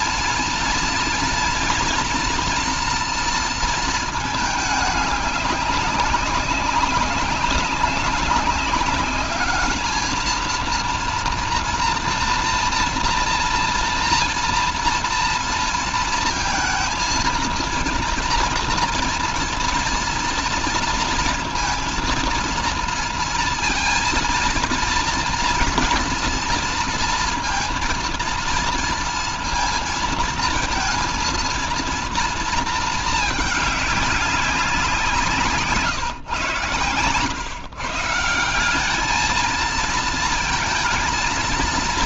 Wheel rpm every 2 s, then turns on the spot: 230, 240, 210, 190, 200, 230, 230, 230, 230, 230, 230, 230, 230, 230, 230, 230, 220, 180, 120, 180, 230.
none